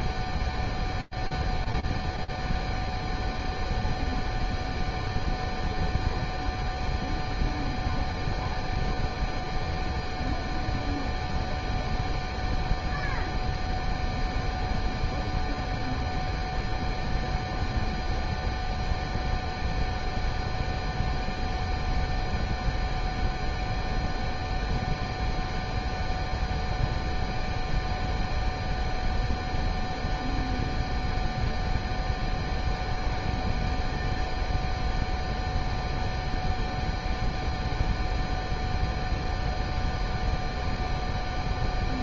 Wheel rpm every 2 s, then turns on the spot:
0, 0, 0, 0, 0, 0, 0, 0, 0, 0, 0, 0, 0, 0, 0, 0, 0, 0, 0, 0, 0.
none